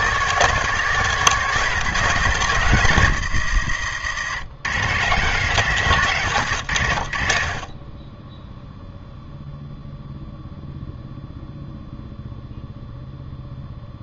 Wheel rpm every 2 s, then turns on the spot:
190, 130, 140, 90, 0, 0, 0.
none